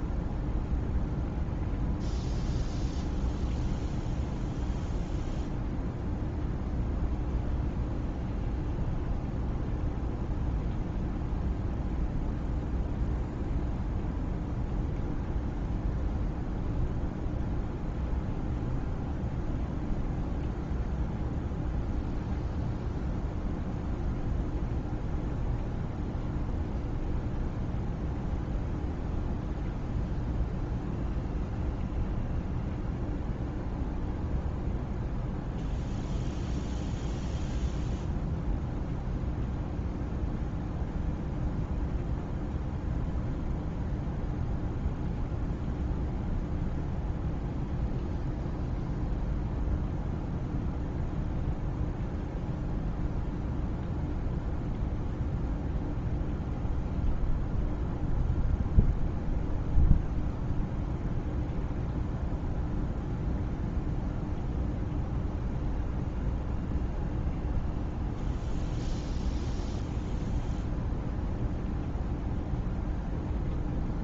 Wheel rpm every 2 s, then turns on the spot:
0, 0, 0, 0, 0, 0, 0, 0, 0, 0, 0, 0, 0, 0, 0, 0, 0, 0, 0, 0, 0, 0, 0, 0, 0, 0, 0, 0, 0, 0, 0, 0, 0, 0, 0, 0, 0.
none